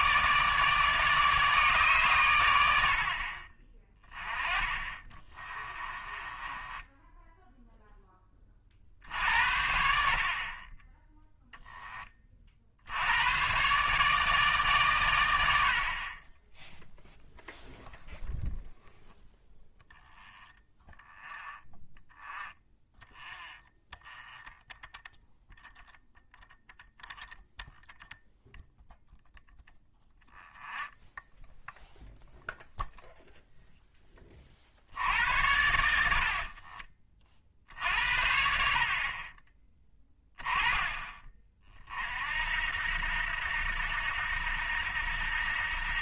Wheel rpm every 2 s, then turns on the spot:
150, 70, 20, 10, 40, 20, 60, 130, 0, 0, 0, 0, 0, 0, 0, 0, 0, 60, 40, 60, 20, 80, 80.
4-8 36-38